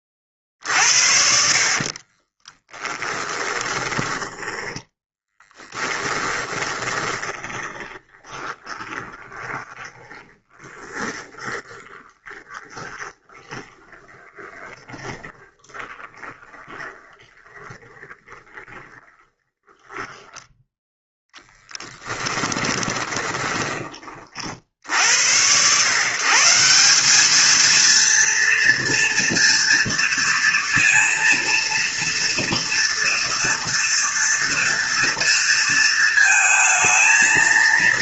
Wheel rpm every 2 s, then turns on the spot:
60, 20, 10, 20, 20, 20, 20, 20, 20, 20, 10, 20, 50, 170, 230, 230, 230, 230, 220.
2-20 22-24